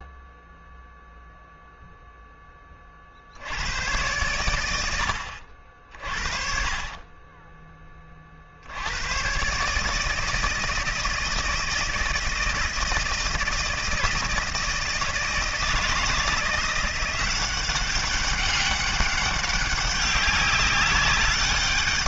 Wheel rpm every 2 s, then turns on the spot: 0, 30, 90, 30, 80, 160, 160, 160, 180, 190, 190.
none